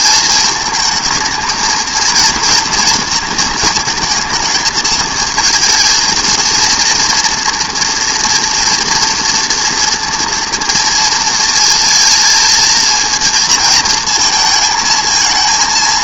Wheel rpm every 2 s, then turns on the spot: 220, 230, 220, 230, 230, 230, 220, 230.
none